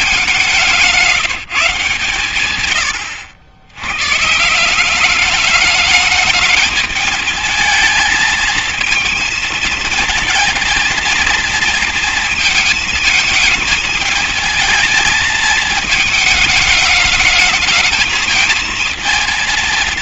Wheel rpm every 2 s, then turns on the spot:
190, 120, 160, 210, 230, 230, 230, 220, 220, 230.
none